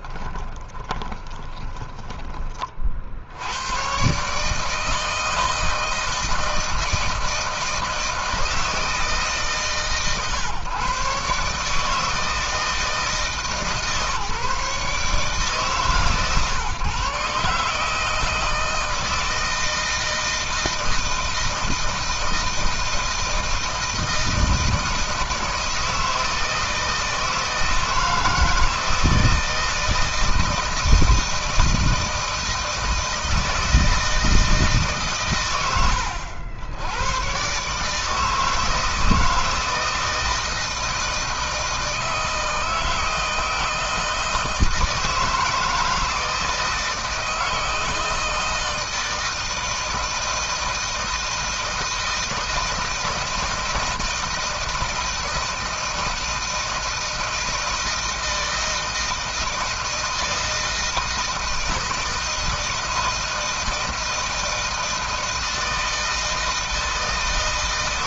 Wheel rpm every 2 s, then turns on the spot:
20, 40, 150, 160, 160, 130, 160, 140, 140, 160, 160, 160, 160, 160, 160, 160, 160, 150, 90, 160, 160, 160, 160, 160, 160, 160, 160, 160, 160, 160, 160, 160, 160, 160.
0-2